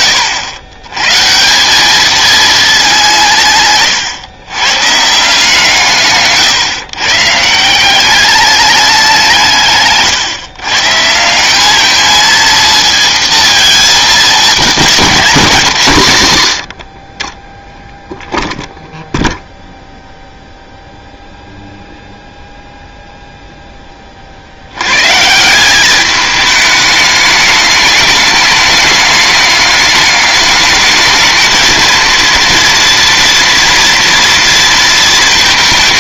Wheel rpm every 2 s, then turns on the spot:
110, 210, 120, 130, 210, 130, 230, 220, 80, 0, 0, 0, 80, 210, 210, 210, 230, 230.
none